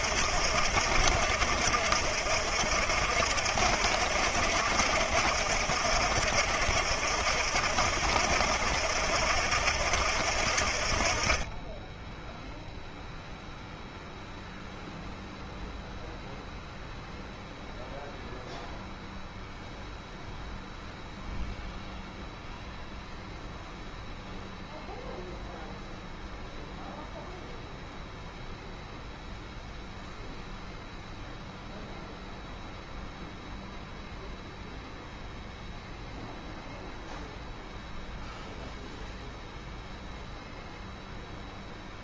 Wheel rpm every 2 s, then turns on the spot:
70, 70, 70, 70, 70, 50, 0, 0, 0, 0, 0, 0, 0, 0, 0, 0, 0, 0, 0, 0, 0.
none